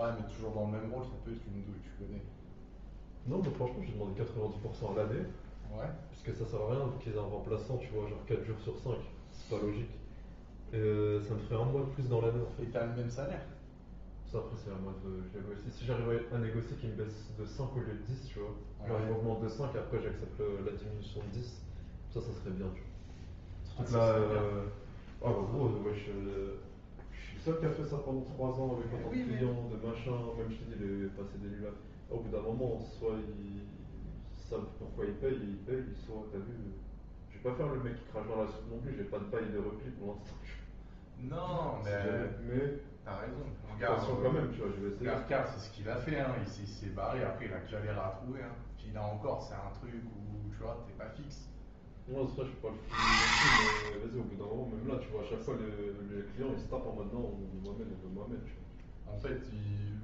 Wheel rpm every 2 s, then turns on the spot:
0, 0, 0, 0, 0, 0, 0, 0, 0, 0, 0, 0, 0, 0, 0, 0, 0, 0, 0, 0, 0, 0, 0, 0, 0, 0, 20, 0, 0, 0.
none